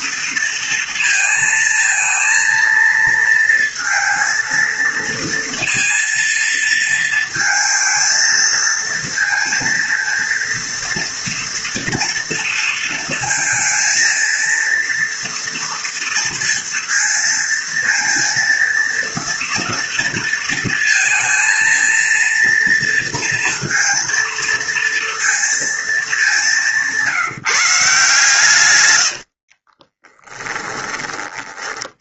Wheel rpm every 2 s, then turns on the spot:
230, 230, 230, 230, 230, 230, 230, 230, 230, 230, 230, 230, 230, 170, 120, 30.
28-30